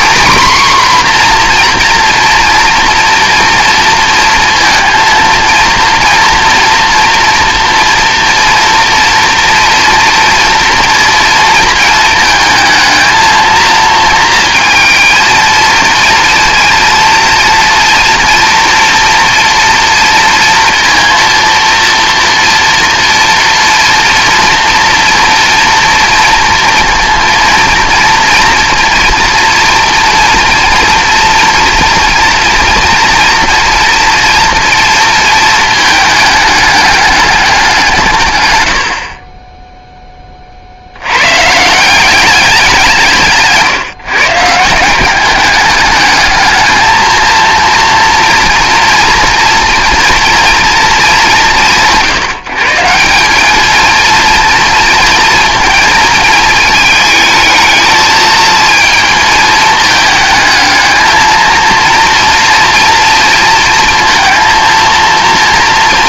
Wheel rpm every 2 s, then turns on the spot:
260, 230, 230, 230, 230, 230, 220, 230, 230, 230, 230, 230, 230, 230, 230, 240, 230, 230, 210, 100, 70, 170, 170, 220, 230, 230, 160, 230, 220, 220, 220, 240, 230.
none